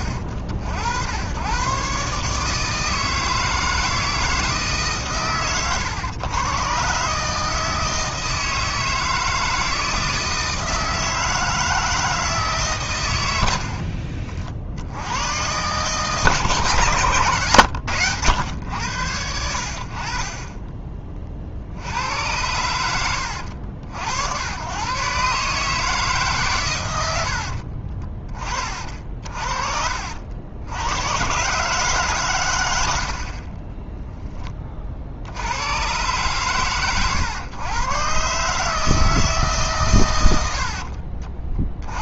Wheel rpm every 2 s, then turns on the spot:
80, 150, 160, 120, 160, 160, 150, 60, 140, 90, 30, 100, 100, 140, 30, 70, 110, 20, 110, 150, 90.
40-42